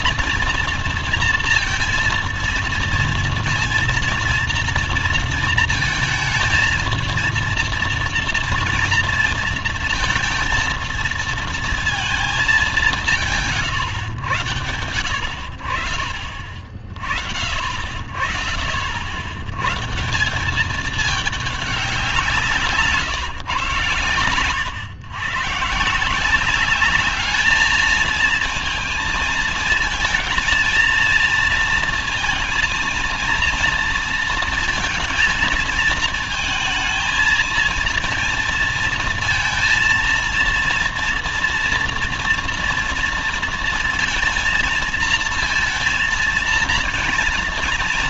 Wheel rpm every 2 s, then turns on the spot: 230, 230, 230, 220, 230, 230, 210, 100, 30, 50, 190, 150, 120, 190, 220, 230, 230, 230, 220, 220, 230, 230, 230, 230.
none